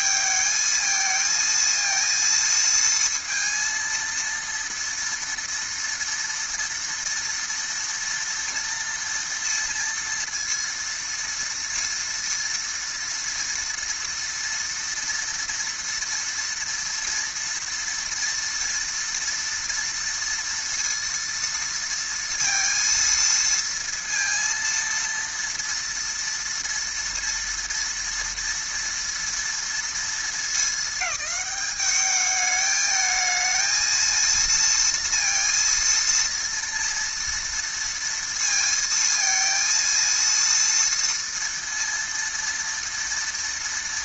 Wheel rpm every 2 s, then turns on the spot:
220, 230, 230, 240, 230, 230, 230, 230, 230, 230, 230, 230, 230, 230, 230, 220, 210, 230, 230, 230, 230, 230.
none